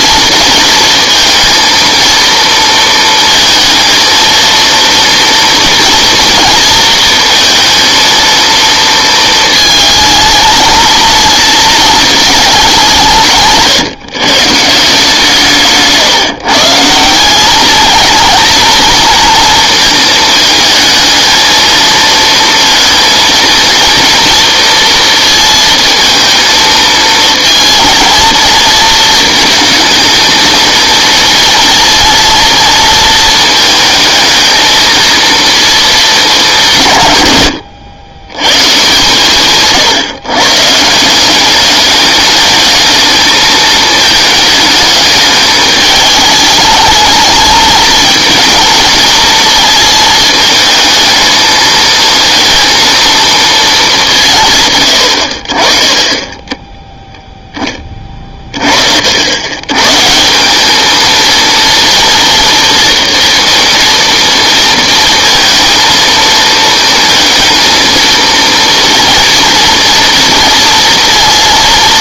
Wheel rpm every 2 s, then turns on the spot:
230, 230, 230, 230, 230, 220, 200, 150, 160, 230, 220, 230, 230, 230, 230, 220, 230, 220, 180, 130, 140, 210, 220, 220, 220, 220, 230, 150, 10, 40, 180, 230, 230, 220, 230, 230.
none